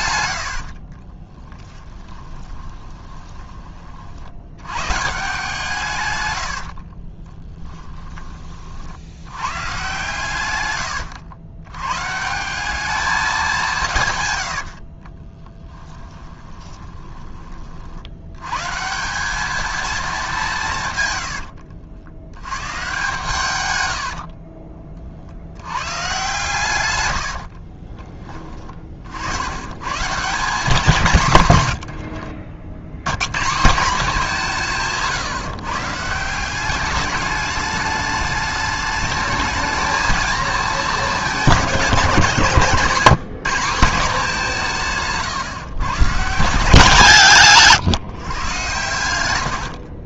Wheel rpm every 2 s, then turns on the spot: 60, 20, 100, 70, 40, 110, 190, 80, 20, 130, 170, 110, 40, 120, 30, 180, 70, 170, 190, 210, 220, 170, 170, 180, 120.
0-4 6-8 14-18 24-26